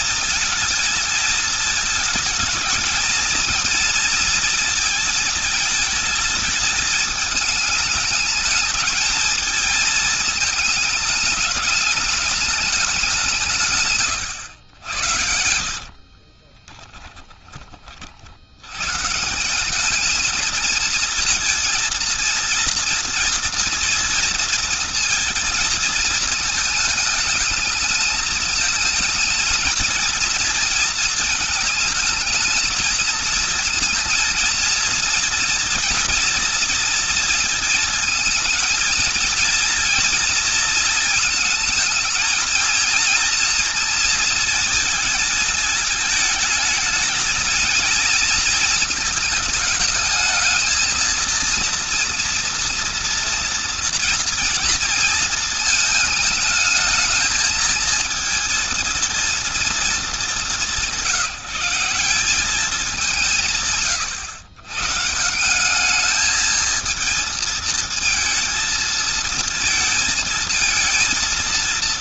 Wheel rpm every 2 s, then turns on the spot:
220, 220, 220, 210, 220, 210, 200, 90, 10, 130, 230, 230, 230, 220, 230, 230, 220, 230, 230, 230, 230, 230, 220, 220, 230, 220, 230, 230, 220, 230, 170, 180, 140, 220, 230, 220.
16-18